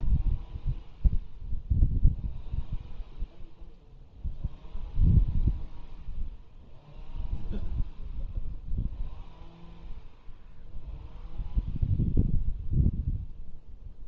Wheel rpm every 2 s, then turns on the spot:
0, 0, 0, 0, 0, 0, 0.
none